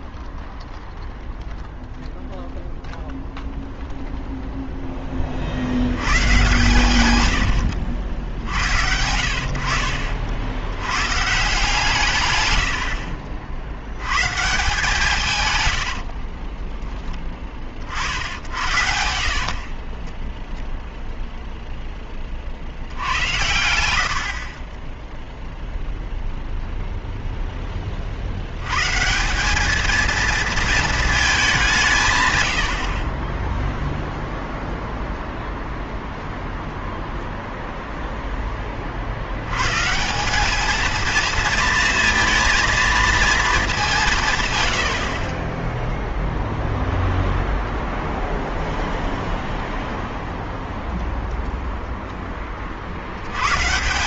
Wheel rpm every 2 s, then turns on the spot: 0, 0, 0, 130, 80, 80, 90, 160, 20, 70, 0, 70, 20, 0, 120, 230, 90, 0, 0, 30, 220, 230, 100, 0, 0, 0, 40.
12-14 16-18